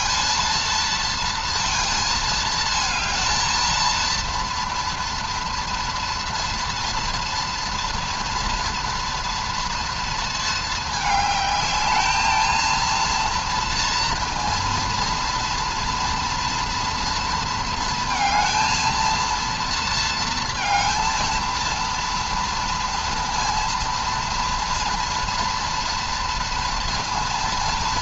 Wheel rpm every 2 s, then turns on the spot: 230, 220, 230, 230, 230, 220, 220, 230, 230, 220, 230, 230, 230, 230.
none